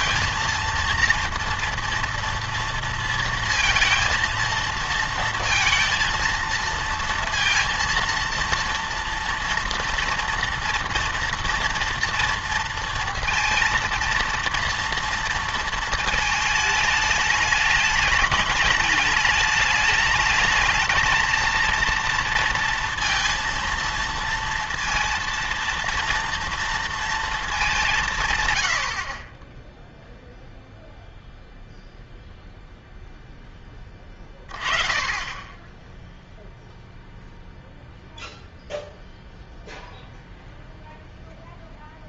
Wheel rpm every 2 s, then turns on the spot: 230, 230, 220, 230, 230, 230, 230, 230, 220, 210, 220, 230, 230, 230, 100, 0, 0, 20, 0, 0, 0.
none